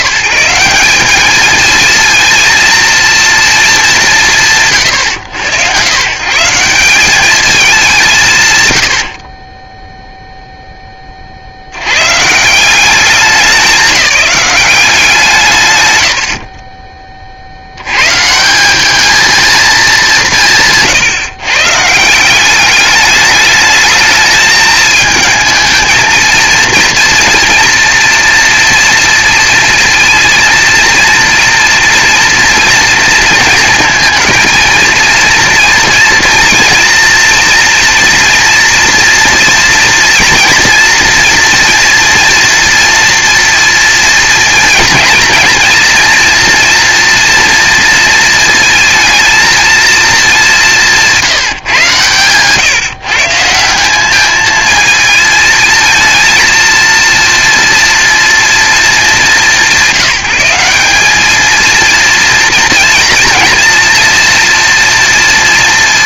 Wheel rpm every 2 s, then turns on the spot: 170, 230, 160, 150, 140, 0, 170, 200, 30, 200, 150, 200, 220, 230, 230, 230, 230, 230, 240, 230, 230, 230, 230, 230, 220, 190, 140, 220, 230, 220, 200, 230, 240.
none